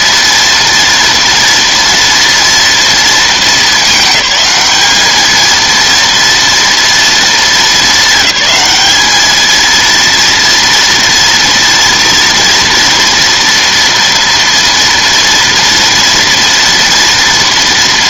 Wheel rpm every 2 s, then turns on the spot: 230, 230, 210, 230, 210, 230, 230, 230, 240.
none